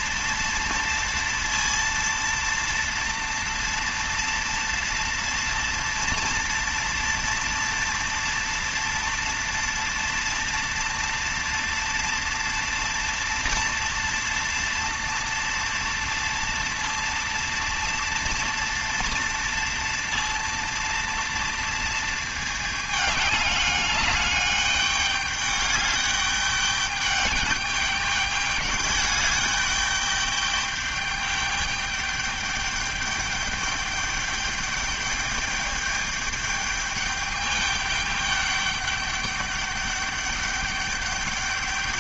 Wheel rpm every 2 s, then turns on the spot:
230, 230, 230, 230, 230, 230, 230, 230, 230, 230, 230, 220, 210, 210, 210, 210, 210, 210, 210, 210, 200.
none